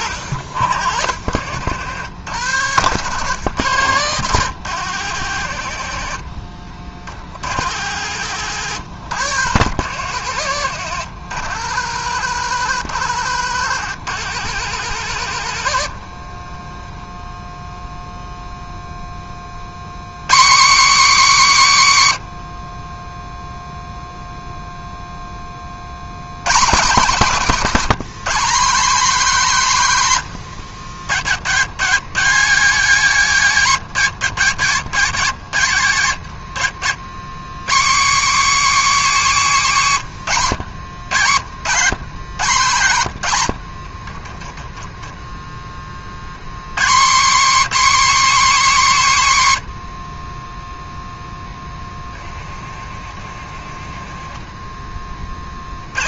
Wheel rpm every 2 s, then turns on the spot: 60, 90, 100, 50, 100, 90, 90, 100, 10, 0, 200, 40, 0, 170, 210, 100, 210, 170, 100, 260, 120, 130, 20, 140, 230, 10, 40, 20.
2-4 10-12 16-18 30-32 40-42 44-46 54-56